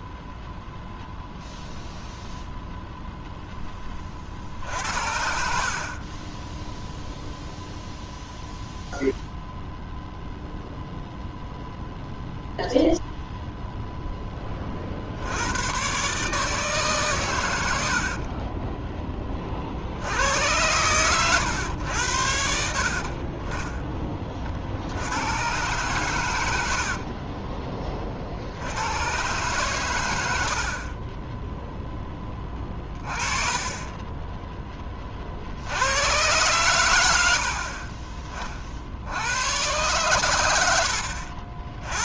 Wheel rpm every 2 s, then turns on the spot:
0, 0, 60, 10, 0, 0, 0, 30, 150, 30, 110, 60, 50, 70, 80, 50, 30, 10, 110, 40, 80.
none